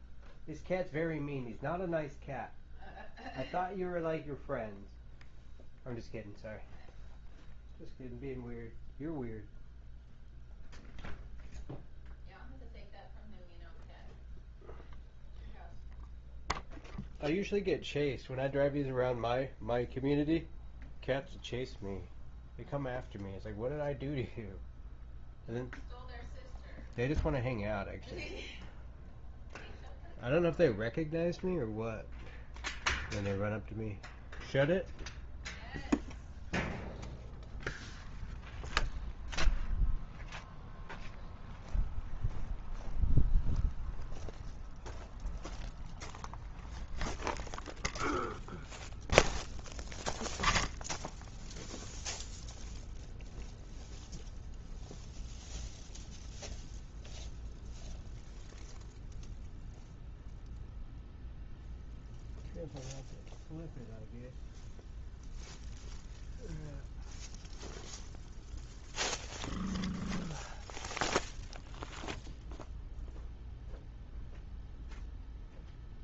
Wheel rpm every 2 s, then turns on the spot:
0, 0, 0, 0, 0, 0, 0, 0, 0, 0, 0, 0, 0, 0, 0, 0, 0, 0, 0, 0, 0, 0, 0, 0, 0, 0, 0, 0, 0, 0, 0, 0, 0, 0, 0, 0, 0, 0.
none